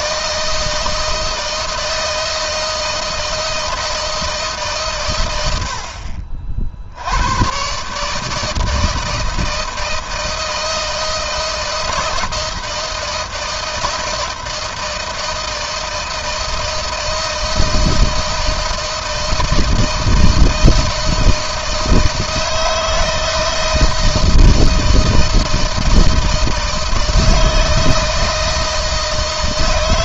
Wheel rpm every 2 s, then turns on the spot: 160, 160, 120, 80, 160, 160, 160, 160, 160, 160, 160, 160, 160, 160, 160.
none